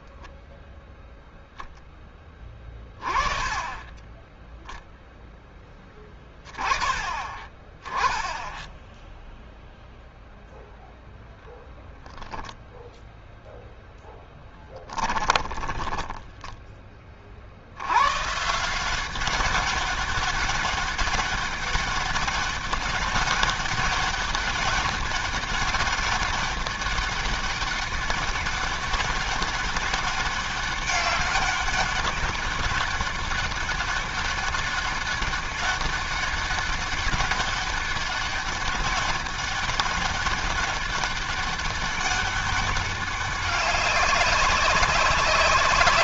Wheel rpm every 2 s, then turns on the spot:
0, 20, 0, 20, 10, 0, 10, 10, 10, 140, 200, 200, 200, 200, 200, 200, 200, 200, 200, 200, 200, 200, 190.
12-16